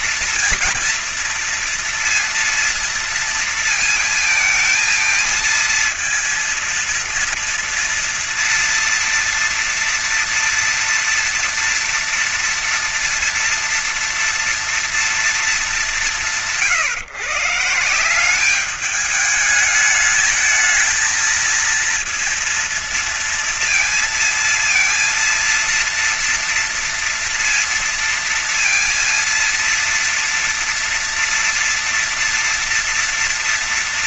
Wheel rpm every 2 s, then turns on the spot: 230, 230, 230, 230, 230, 230, 230, 230, 160, 190, 220, 230, 230, 230, 230, 230, 230.
none